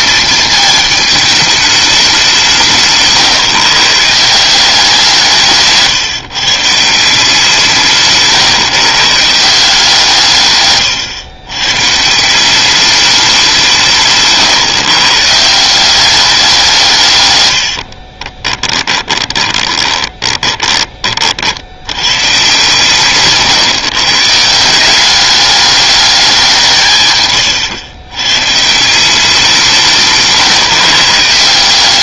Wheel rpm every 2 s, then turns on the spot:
220, 160, 180, 150, 140, 140, 190, 140, 190, 20, 20, 130, 160, 180, 130, 150.
18-22